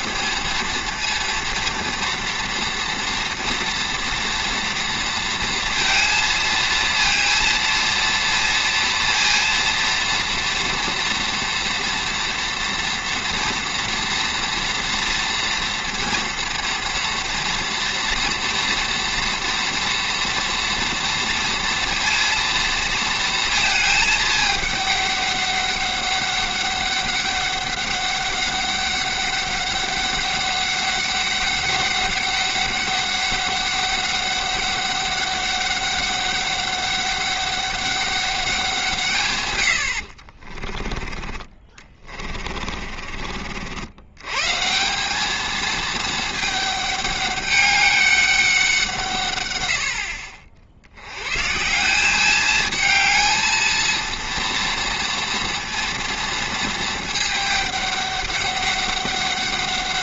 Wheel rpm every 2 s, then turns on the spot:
230, 230, 230, 230, 230, 230, 230, 230, 230, 230, 230, 230, 210, 200, 200, 200, 200, 200, 200, 190, 40, 40, 150, 210, 190, 60, 210, 230, 220, 200.
40-44